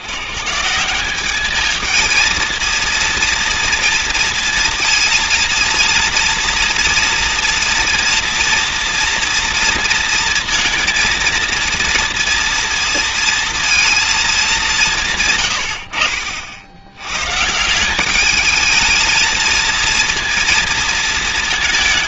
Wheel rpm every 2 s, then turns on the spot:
70, 220, 230, 230, 230, 230, 230, 220, 70, 210, 230.
none